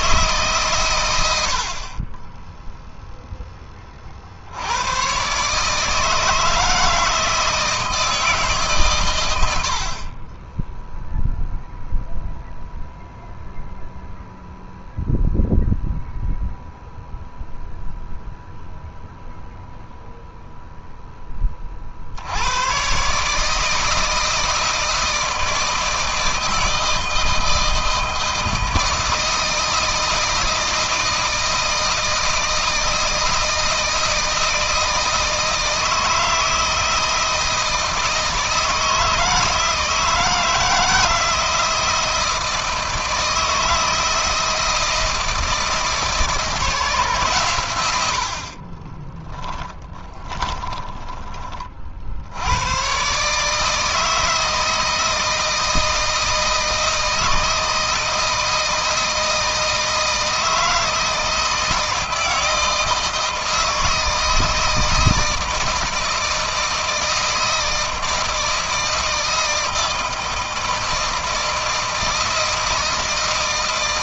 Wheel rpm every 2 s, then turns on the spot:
120, 0, 110, 160, 120, 0, 0, 0, 0, 0, 10, 130, 160, 160, 160, 160, 160, 160, 160, 160, 160, 160, 160, 150, 20, 20, 130, 160, 160, 160, 160, 160, 160, 160, 160, 160, 160.
48-52